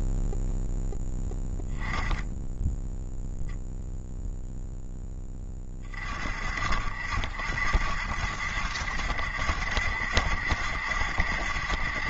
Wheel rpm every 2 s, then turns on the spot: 0, 10, 60, 70, 70, 60.
none